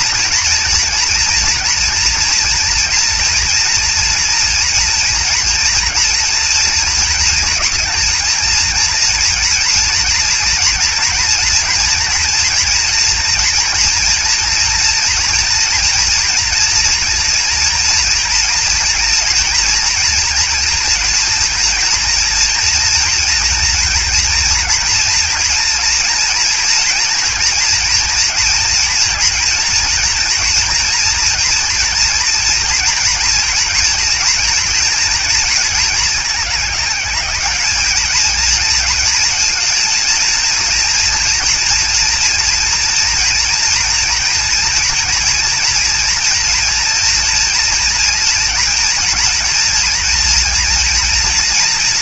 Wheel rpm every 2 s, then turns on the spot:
240, 230, 230, 240, 230, 230, 230, 240, 230, 230, 240, 230, 240, 230, 230, 230, 230, 230, 210, 230, 230, 230, 240, 240, 240, 240.
none